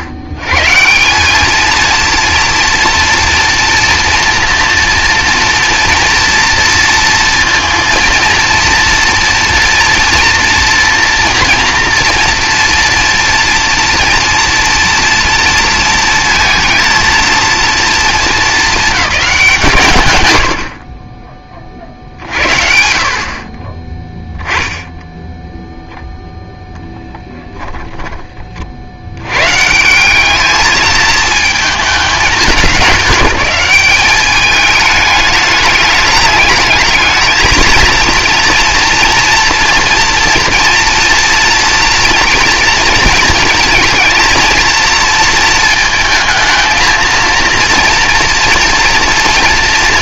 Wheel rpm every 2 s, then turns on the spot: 110, 230, 240, 230, 230, 240, 230, 230, 230, 220, 70, 50, 10, 0, 40, 210, 200, 210, 210, 230, 240, 230, 220, 220, 230.
none